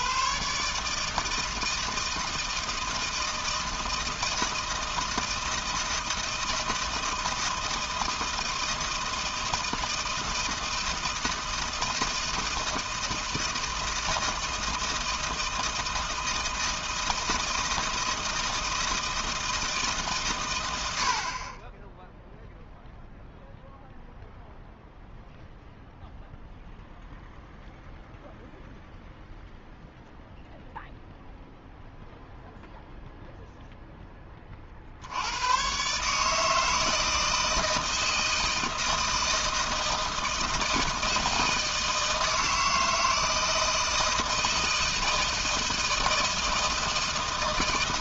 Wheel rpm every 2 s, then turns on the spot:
140, 160, 160, 160, 160, 160, 170, 160, 160, 160, 100, 0, 0, 0, 0, 0, 0, 30, 160, 160, 160, 160, 160, 160.
none